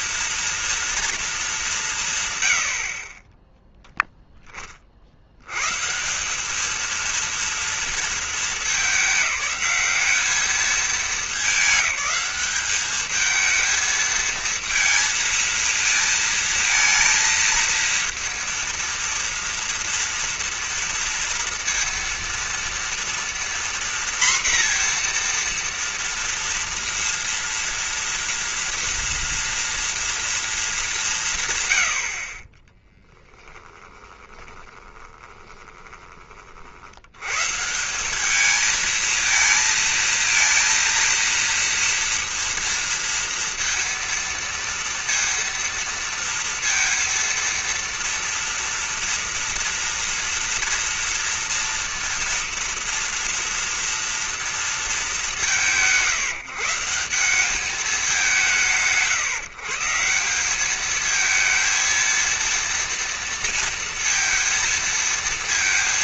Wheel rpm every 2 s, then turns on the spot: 230, 80, 20, 200, 220, 210, 210, 220, 230, 230, 230, 230, 240, 230, 230, 230, 50, 20, 50, 210, 230, 230, 230, 230, 230, 230, 230, 230, 160, 140, 200, 230, 230.
32-36